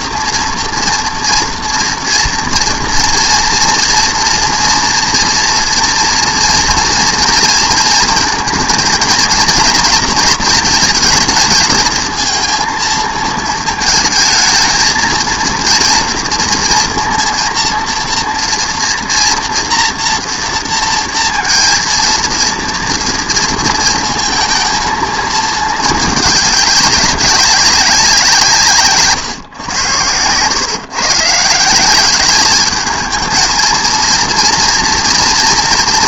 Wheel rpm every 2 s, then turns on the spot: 230, 230, 230, 230, 230, 230, 220, 220, 230, 230, 230, 230, 230, 200, 150, 130, 210, 230.
none